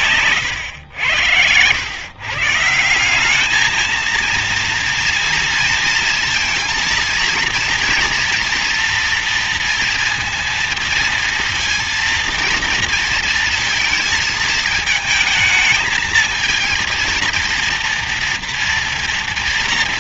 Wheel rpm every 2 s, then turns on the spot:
130, 130, 230, 230, 230, 230, 230, 220, 220, 230.
none